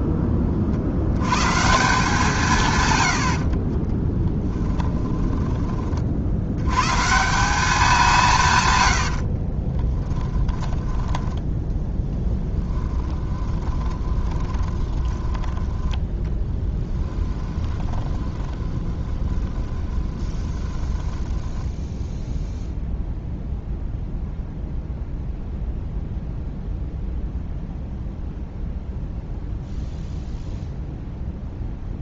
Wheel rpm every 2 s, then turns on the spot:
20, 160, 20, 60, 180, 20, 10, 20, 10, 20, 20, 0, 0, 0, 0, 0.
4-6 10-12 14-22